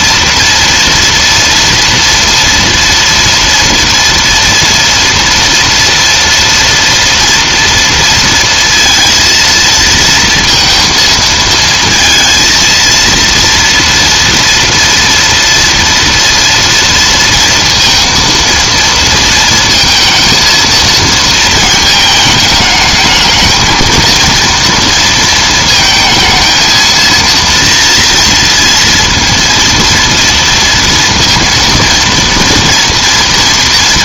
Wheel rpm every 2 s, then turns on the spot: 230, 230, 230, 230, 230, 230, 220, 230, 230, 230, 230, 220, 230, 220, 230, 230, 230.
none